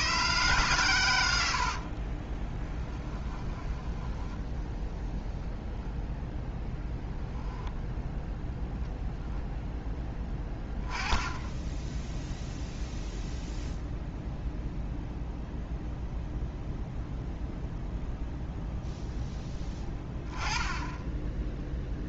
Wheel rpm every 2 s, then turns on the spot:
130, 10, 10, 10, 0, 10, 0, 0, 0, 0, 10.
2-4